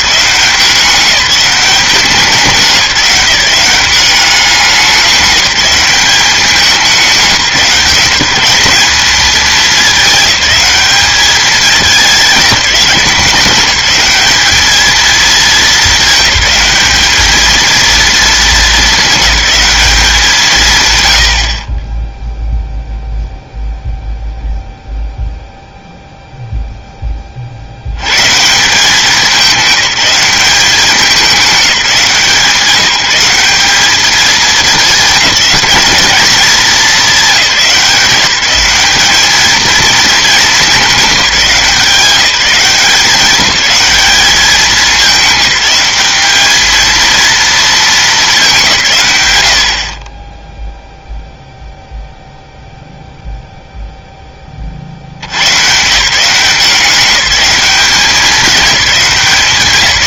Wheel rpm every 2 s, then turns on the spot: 190, 190, 190, 190, 190, 200, 200, 220, 210, 210, 120, 0, 0, 0, 170, 190, 170, 210, 210, 200, 210, 190, 210, 220, 170, 0, 0, 40, 180, 200.
none